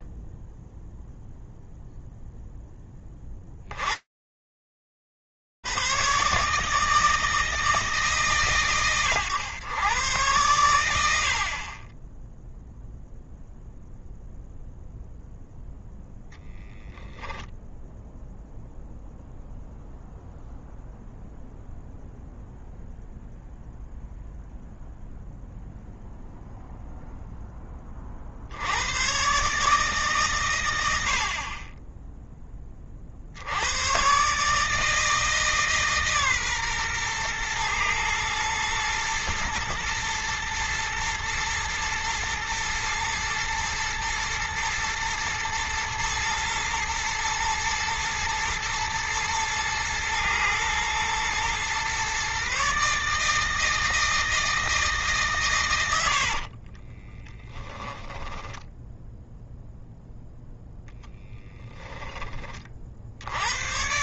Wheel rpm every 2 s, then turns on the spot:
0, 10, 130, 140, 100, 10, 0, 0, 0, 0, 0, 0, 0, 0, 110, 70, 50, 160, 120, 110, 110, 110, 110, 110, 120, 120, 140, 160, 40, 10, 0, 40.
56-58